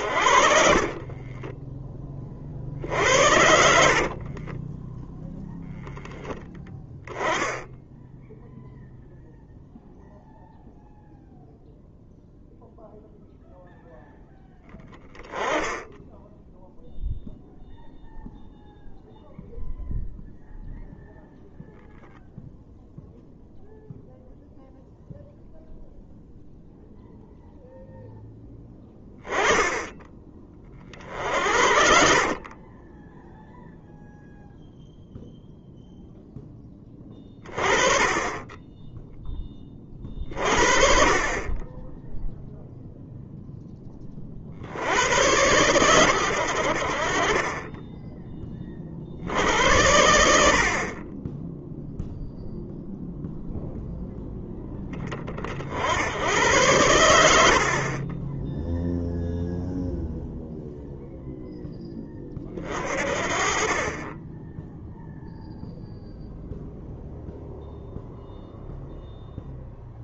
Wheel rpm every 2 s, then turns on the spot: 30, 70, 10, 10, 0, 0, 0, 10, 0, 0, 0, 0, 0, 0, 10, 40, 20, 0, 10, 20, 40, 0, 80, 50, 40, 40, 0, 20, 100, 0, 0, 40, 0, 0, 0.
0-6 30-34